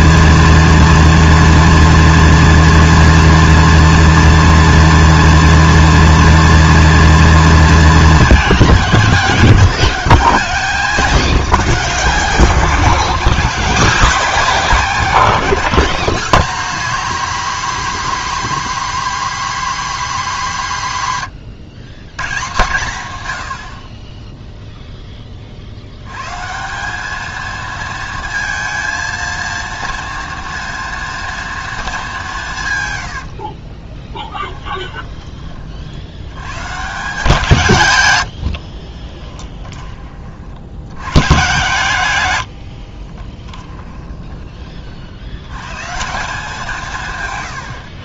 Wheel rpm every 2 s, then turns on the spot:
230, 230, 230, 230, 200, 190, 170, 190, 240, 260, 160, 120, 10, 210, 230, 230, 100, 20, 160, 30, 110, 40, 50, 160.
32-34 38-40 42-44